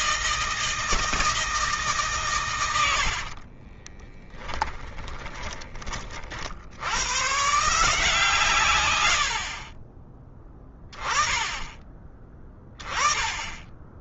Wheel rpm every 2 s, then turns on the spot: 160, 90, 10, 100, 100, 10, 20.
2-6